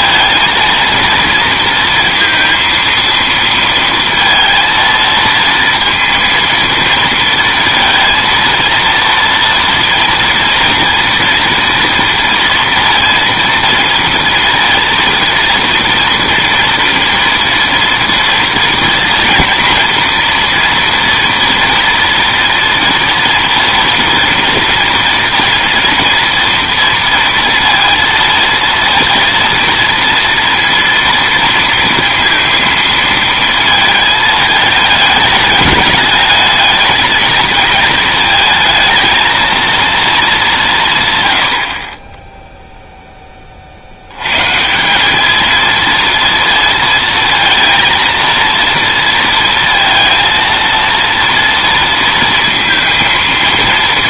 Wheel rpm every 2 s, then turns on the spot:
230, 230, 230, 230, 230, 230, 230, 230, 230, 230, 230, 230, 230, 230, 230, 230, 230, 210, 220, 220, 190, 0, 140, 230, 230, 230, 230.
none